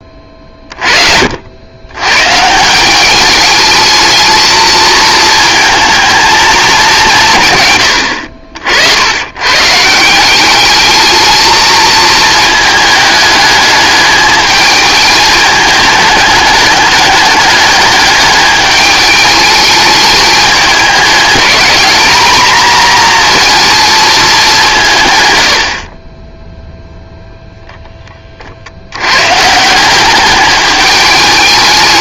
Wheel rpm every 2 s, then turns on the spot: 40, 160, 220, 210, 70, 200, 220, 220, 210, 210, 210, 230, 170, 0, 70, 210.
none